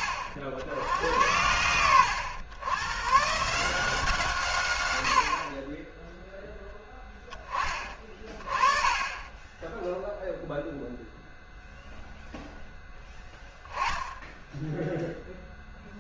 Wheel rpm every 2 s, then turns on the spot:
60, 100, 120, 0, 20, 0, 0, 0.
none